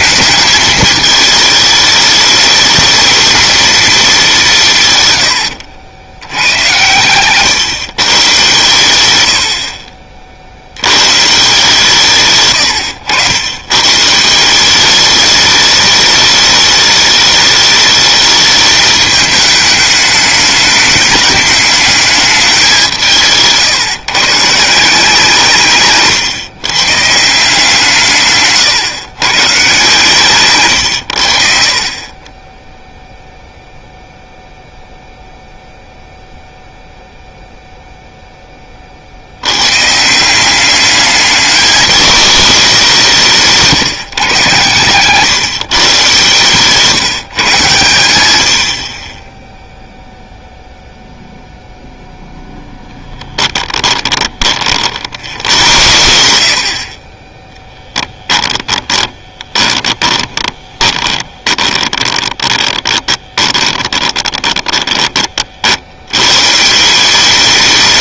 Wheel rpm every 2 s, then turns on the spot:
220, 220, 160, 110, 120, 80, 120, 190, 210, 220, 210, 190, 170, 140, 130, 110, 10, 0, 0, 30, 200, 200, 130, 150, 80, 0, 10, 50, 70, 10, 20, 20, 20, 160.
6-8 46-48 52-54 58-66